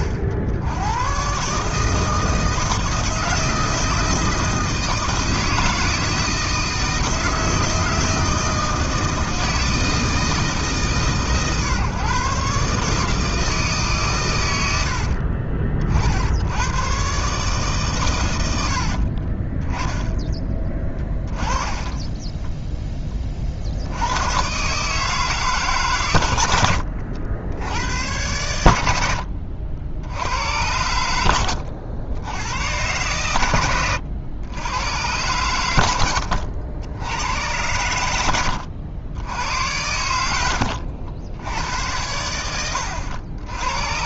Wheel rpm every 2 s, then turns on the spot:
80, 160, 160, 160, 160, 160, 140, 100, 100, 100, 20, 10, 130, 100, 100, 80, 90, 90, 80, 80, 80, 90.
20-22 40-42